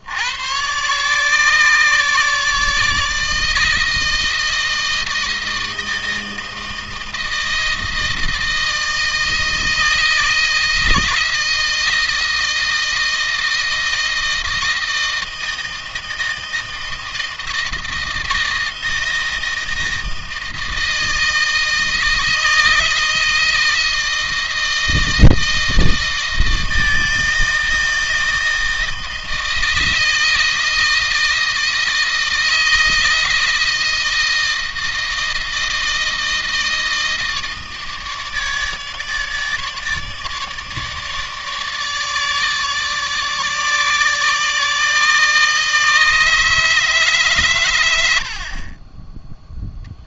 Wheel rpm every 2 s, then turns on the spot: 130, 150, 160, 160, 160, 160, 160, 160, 160, 160, 160, 160, 160, 160, 160, 160, 160, 160, 160, 150, 150, 150, 150, 150, 30.
none